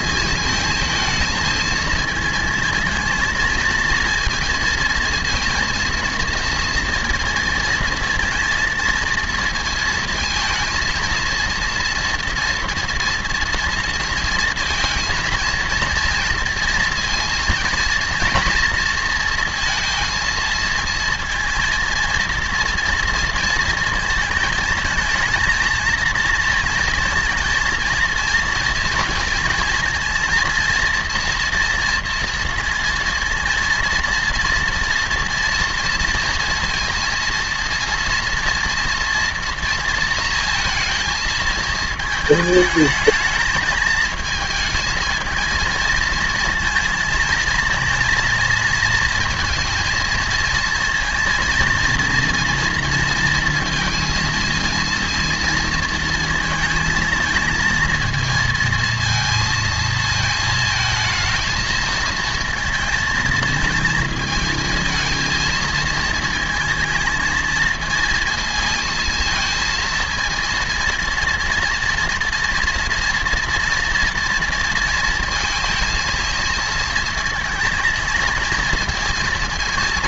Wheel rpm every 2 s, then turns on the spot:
220, 230, 230, 230, 230, 230, 230, 230, 230, 230, 230, 230, 220, 230, 240, 230, 230, 230, 230, 230, 220, 220, 230, 230, 230, 230, 230, 230, 230, 230, 230, 230, 220, 230, 230, 230, 230, 230, 220, 230.
none